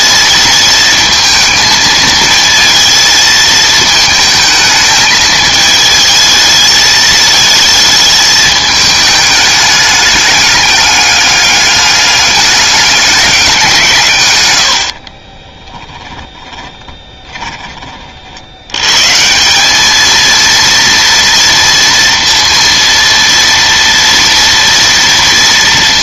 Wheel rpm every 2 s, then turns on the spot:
220, 230, 220, 220, 220, 210, 200, 80, 20, 110, 230, 230, 230.
14-18